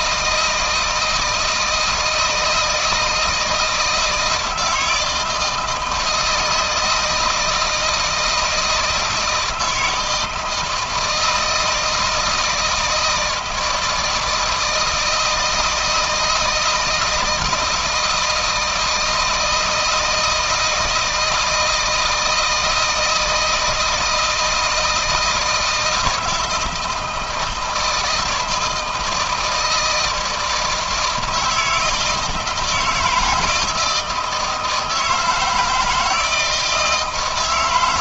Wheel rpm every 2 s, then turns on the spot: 160, 160, 160, 160, 160, 160, 160, 160, 160, 160, 160, 160, 160, 160, 160, 160, 170, 160, 160.
none